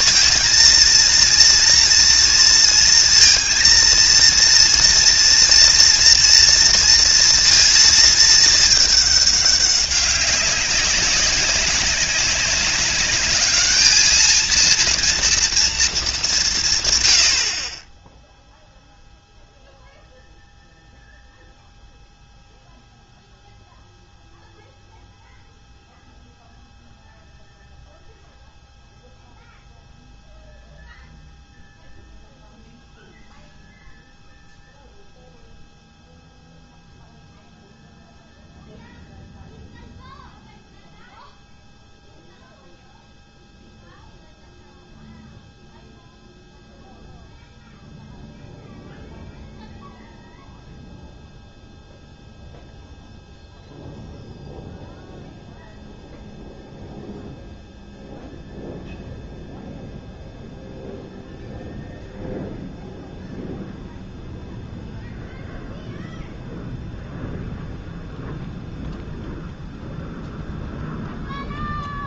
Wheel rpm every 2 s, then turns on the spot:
230, 230, 240, 230, 220, 200, 200, 230, 150, 0, 0, 0, 0, 0, 0, 0, 0, 0, 0, 0, 0, 0, 0, 0, 0, 0, 0, 0, 0, 0, 0, 0, 0, 0, 0, 0.
none